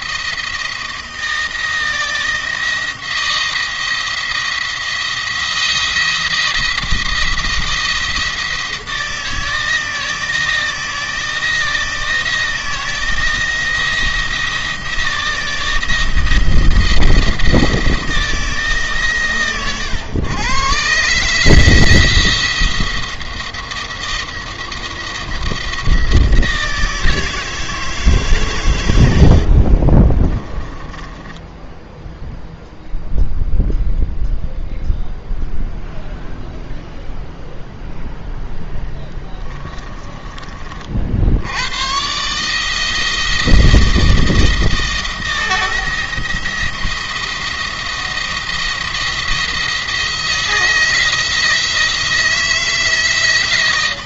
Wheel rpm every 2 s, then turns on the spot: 160, 170, 170, 170, 160, 160, 170, 170, 170, 150, 140, 170, 170, 160, 110, 20, 0, 0, 0, 10, 40, 150, 160, 170, 170, 160, 160.
30-32